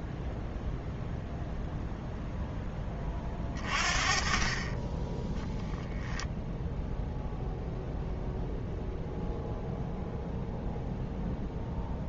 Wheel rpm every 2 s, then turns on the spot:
0, 10, 30, 0, 0, 0.
none